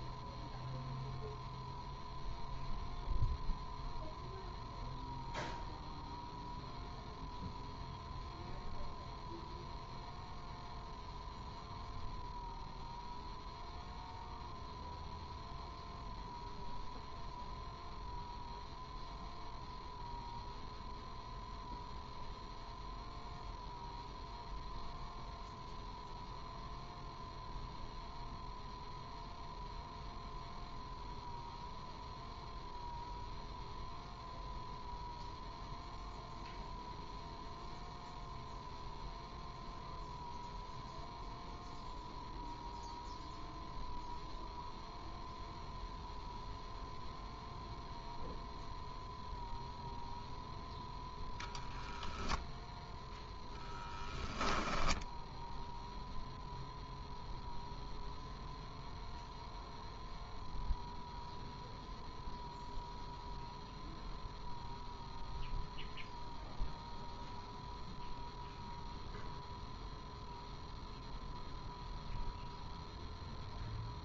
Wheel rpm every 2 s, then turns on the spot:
0, 0, 0, 0, 0, 0, 0, 0, 0, 0, 0, 0, 0, 0, 0, 0, 0, 0, 0, 0, 0, 0, 0, 0, 0, 0, 0, 10, 0, 0, 0, 0, 0, 0, 0, 0, 0.
54-56